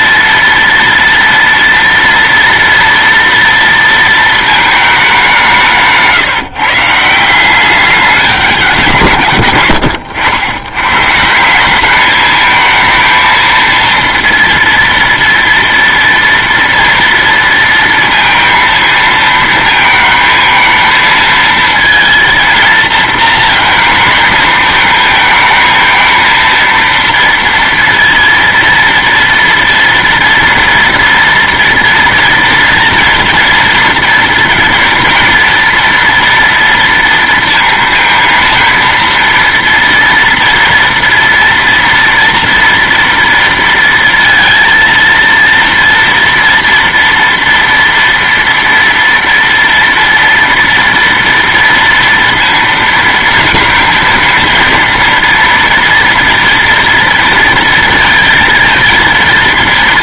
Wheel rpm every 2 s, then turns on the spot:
230, 230, 220, 150, 180, 80, 210, 230, 230, 230, 220, 230, 220, 230, 230, 230, 240, 230, 240, 230, 230, 230, 230, 230, 230, 230, 230, 230, 230, 230.
none